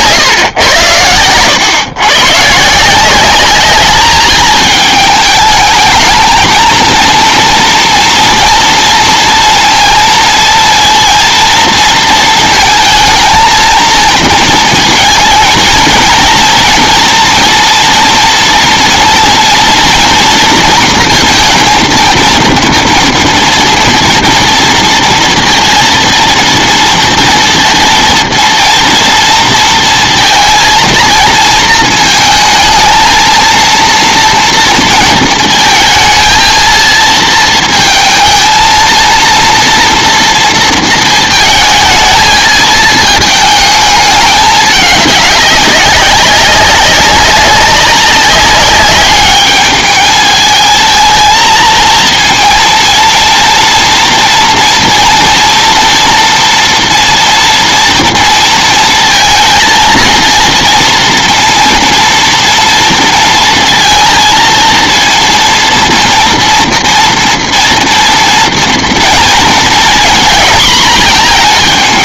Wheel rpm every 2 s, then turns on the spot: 110, 160, 220, 230, 230, 230, 220, 230, 240, 230, 230, 230, 230, 230, 230, 230, 220, 230, 230, 230, 230, 220, 210, 200, 200, 220, 230, 230, 230, 230, 230, 230, 230, 230, 230, 230.
none